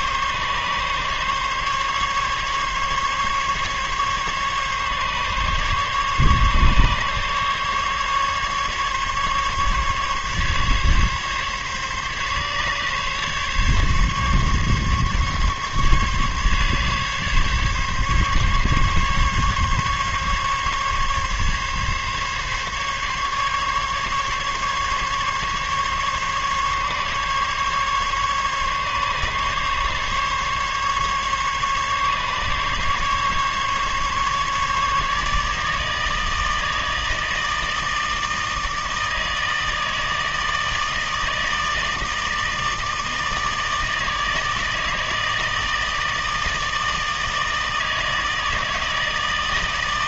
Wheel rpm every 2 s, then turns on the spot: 140, 140, 140, 140, 140, 140, 140, 140, 140, 140, 140, 140, 140, 140, 140, 140, 140, 150, 160, 160, 160, 160, 160, 160, 160.
none